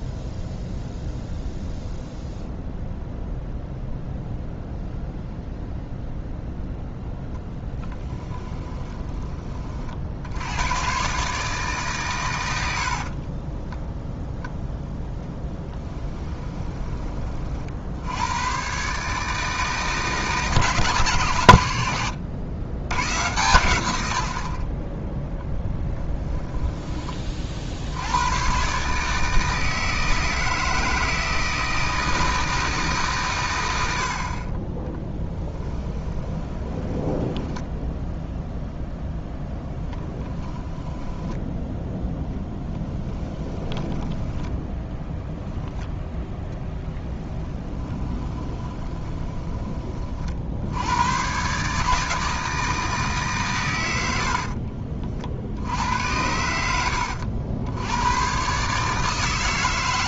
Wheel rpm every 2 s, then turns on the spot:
0, 0, 0, 0, 20, 110, 70, 0, 20, 130, 160, 110, 40, 10, 140, 160, 150, 20, 20, 0, 10, 10, 10, 0, 20, 90, 160, 50, 90, 140.
8-10 12-14 36-38 42-44 48-50 54-56